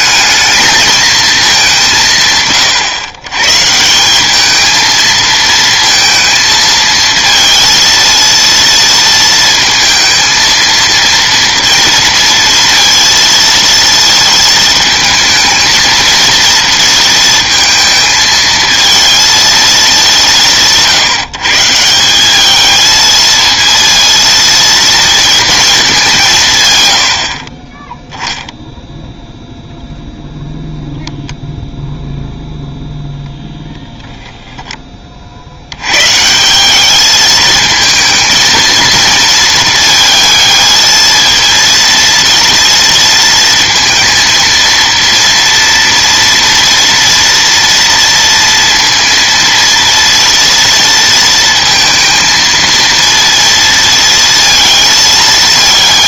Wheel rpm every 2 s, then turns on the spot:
220, 130, 220, 220, 230, 230, 230, 220, 230, 230, 160, 220, 230, 110, 0, 0, 0, 20, 190, 220, 220, 230, 230, 230, 230, 230, 230, 220.
none